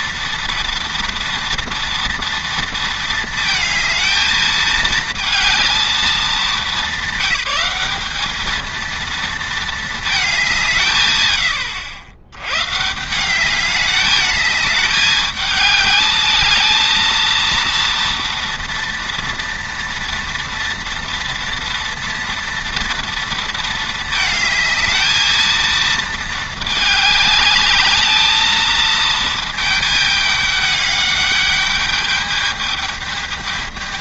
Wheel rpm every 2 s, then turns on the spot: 230, 230, 220, 210, 220, 170, 130, 210, 220, 240, 230, 230, 220, 210, 220, 210, 210.
none